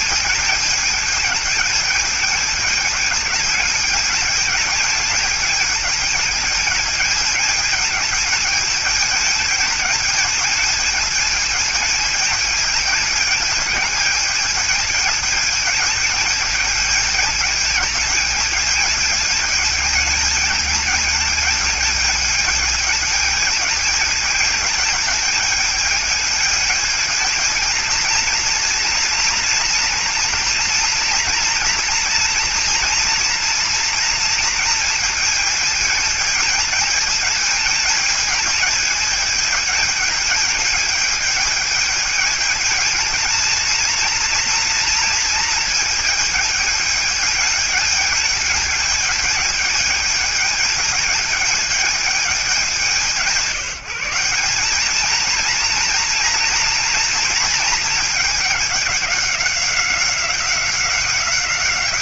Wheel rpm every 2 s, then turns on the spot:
210, 210, 220, 220, 220, 220, 220, 210, 210, 220, 210, 220, 220, 220, 230, 230, 230, 230, 220, 220, 220, 220, 230, 220, 210, 210, 180, 200, 230, 210, 190.
none